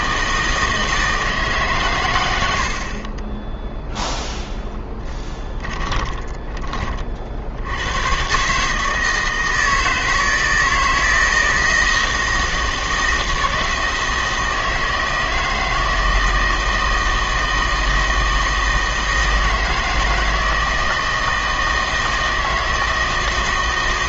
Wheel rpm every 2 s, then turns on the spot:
160, 80, 0, 20, 140, 160, 160, 160, 160, 160, 160, 160.
none